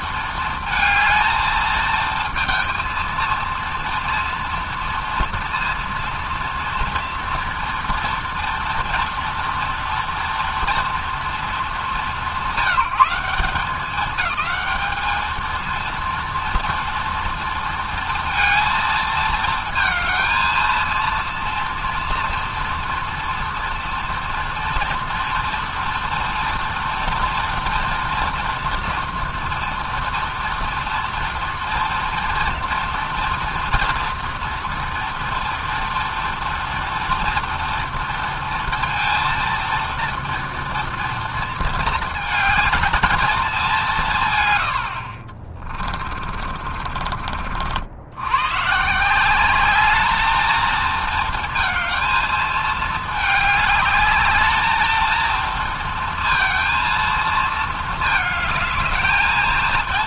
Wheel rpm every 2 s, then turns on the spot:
220, 230, 230, 230, 230, 210, 190, 220, 230, 230, 230, 230, 230, 240, 240, 230, 230, 230, 230, 230, 220, 210, 50, 60, 190, 230, 210, 230, 230, 230.
44-46